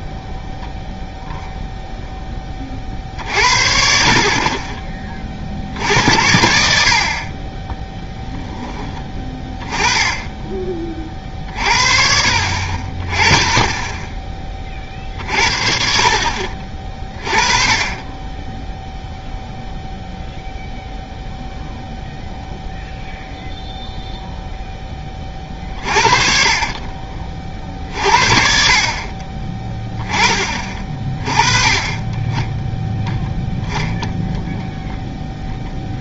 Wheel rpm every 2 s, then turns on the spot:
0, 30, 30, 70, 20, 30, 40, 40, 40, 0, 0, 0, 10, 30, 40, 30, 10, 0.
none